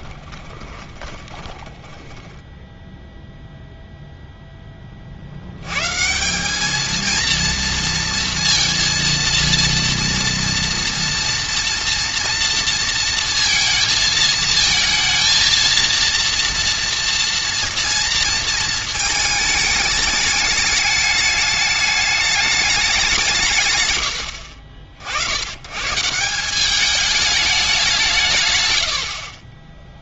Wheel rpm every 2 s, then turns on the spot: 20, 10, 10, 210, 230, 230, 230, 220, 230, 230, 210, 210, 60, 190, 120.
0-4